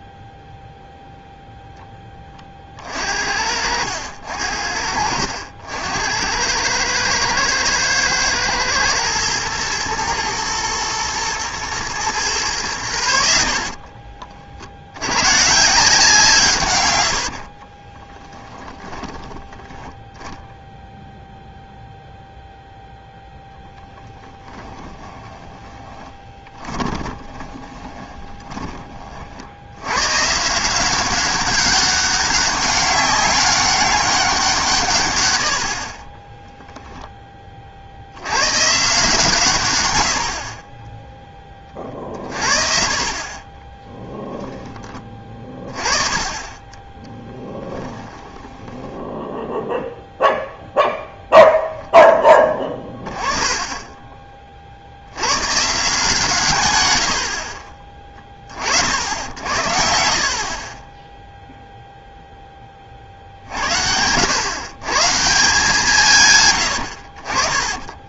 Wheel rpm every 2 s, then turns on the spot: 0, 40, 70, 100, 110, 120, 100, 70, 120, 20, 0, 0, 10, 20, 30, 190, 200, 150, 10, 130, 30, 40, 20, 20, 10, 0, 20, 50, 110, 50, 30, 30, 130, 100.
18-20 24-28 36-38 48-50